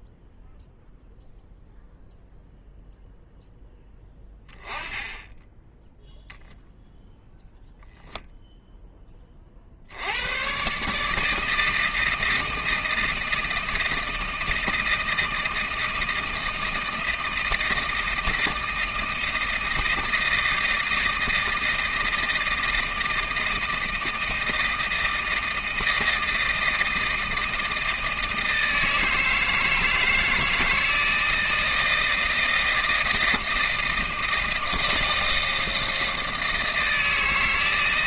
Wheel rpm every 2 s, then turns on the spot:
0, 0, 10, 0, 0, 130, 160, 160, 160, 160, 160, 160, 160, 160, 160, 160, 160, 160, 160.
none